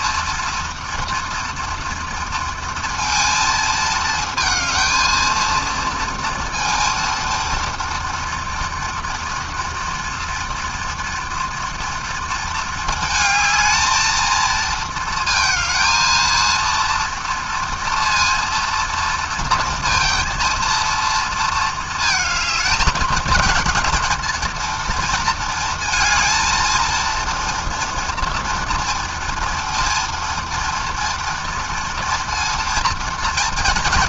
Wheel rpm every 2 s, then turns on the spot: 230, 230, 230, 230, 230, 240, 220, 230, 230, 230, 230, 210, 230, 230, 230, 230, 230.
none